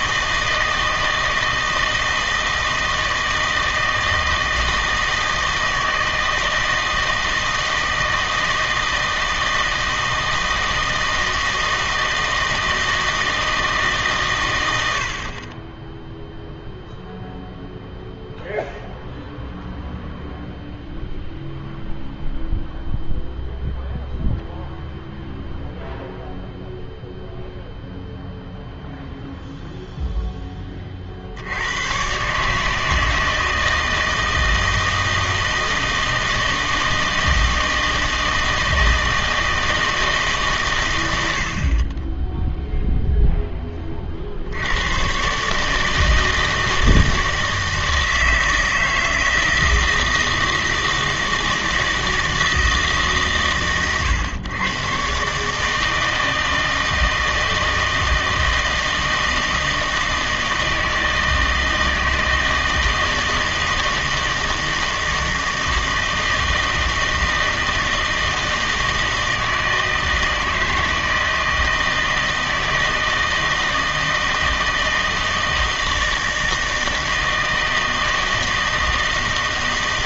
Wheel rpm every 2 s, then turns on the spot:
160, 160, 160, 160, 160, 160, 160, 90, 0, 0, 0, 0, 0, 0, 0, 30, 150, 160, 160, 160, 120, 0, 90, 160, 160, 160, 160, 130, 160, 160, 160, 160, 160, 160, 160, 160, 160, 160, 160, 160.
none